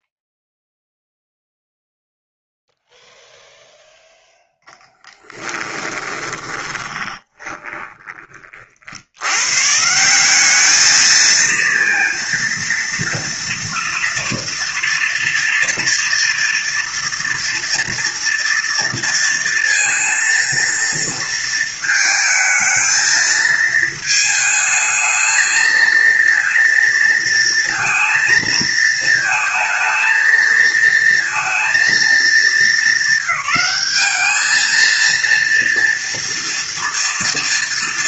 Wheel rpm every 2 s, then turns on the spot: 0, 0, 0, 20, 50, 200, 230, 230, 230, 230, 230, 220, 220, 230, 230, 220, 210, 220, 230.
6-8